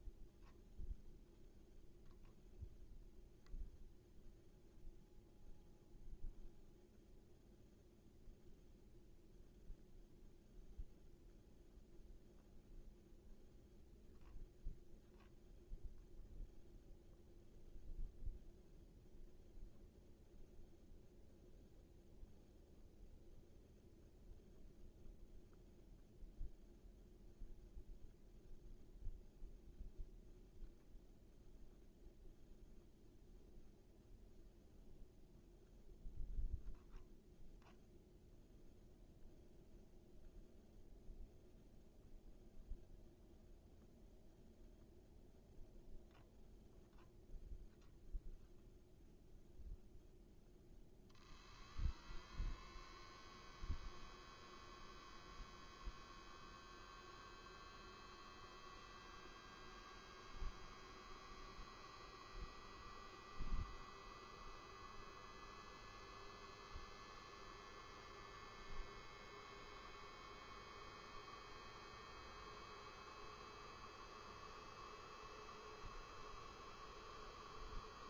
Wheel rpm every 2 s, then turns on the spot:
0, 0, 0, 0, 0, 0, 0, 0, 0, 0, 0, 0, 0, 0, 0, 0, 0, 0, 0, 0, 0, 0, 0, 0, 0, 0, 0, 0, 0, 0, 0, 0, 0, 0, 0, 0, 0, 0, 0.
none